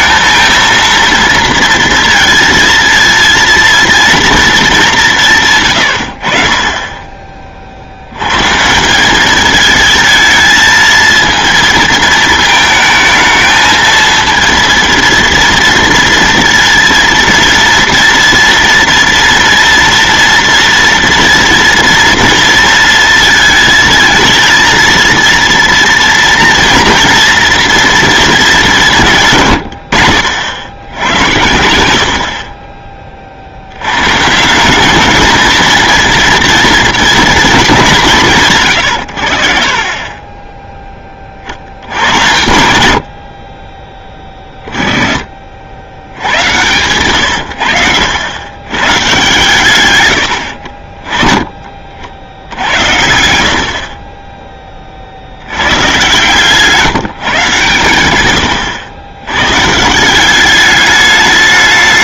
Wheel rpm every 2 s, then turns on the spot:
230, 220, 210, 40, 140, 220, 220, 230, 230, 230, 230, 230, 230, 230, 210, 90, 40, 180, 230, 130, 20, 90, 20, 110, 110, 60, 70, 20, 160, 110, 200.
none